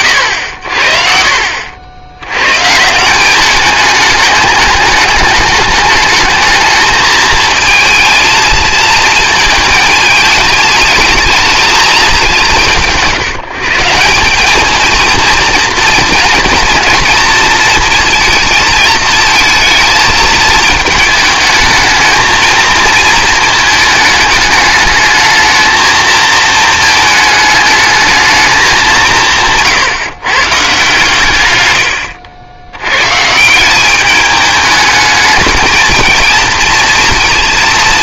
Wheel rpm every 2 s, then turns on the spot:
80, 120, 210, 220, 220, 210, 180, 200, 230, 230, 220, 220, 210, 220, 210, 140, 100, 210, 230.
none